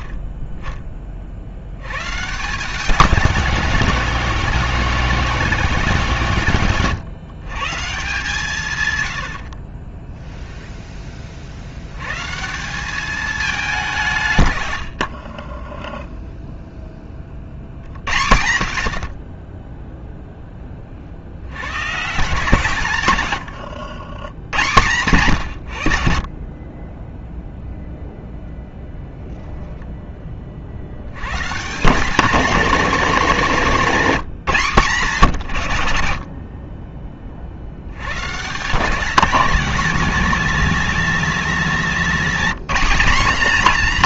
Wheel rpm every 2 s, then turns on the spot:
30, 180, 190, 130, 110, 20, 200, 80, 10, 50, 40, 130, 120, 20, 0, 70, 230, 150, 40, 190, 200, 220.
14-16